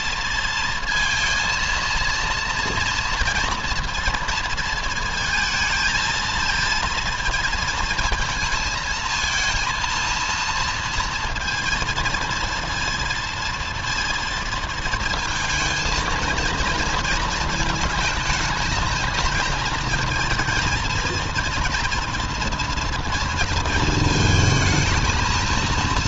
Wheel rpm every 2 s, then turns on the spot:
230, 230, 220, 230, 230, 230, 230, 230, 230, 220, 230, 230, 220.
none